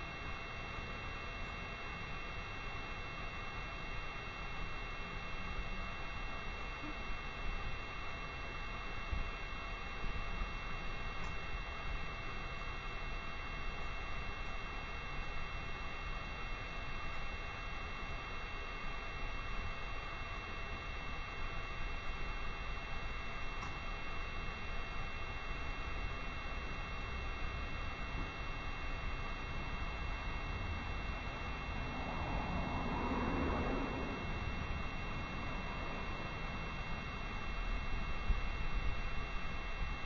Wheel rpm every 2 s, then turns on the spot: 0, 0, 0, 0, 0, 0, 0, 0, 0, 0, 0, 0, 0, 0, 0, 0, 0, 0, 0, 0.
none